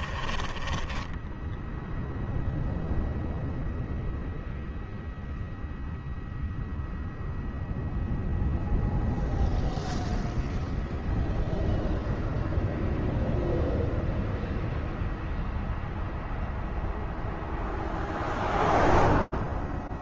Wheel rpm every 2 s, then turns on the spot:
30, 0, 0, 0, 0, 0, 0, 0, 0, 0.
0-2